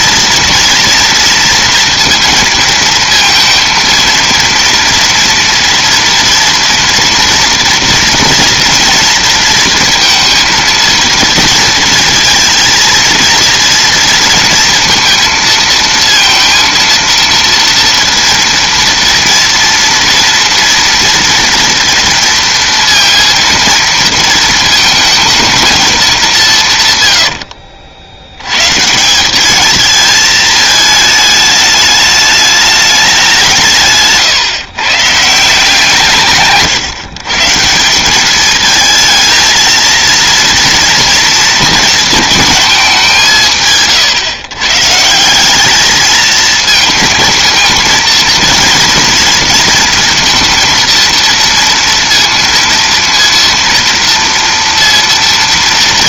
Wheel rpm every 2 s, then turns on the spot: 230, 230, 230, 230, 230, 230, 230, 230, 230, 230, 230, 230, 220, 150, 130, 220, 210, 130, 150, 210, 230, 220, 140, 220, 230, 230, 230, 230.
none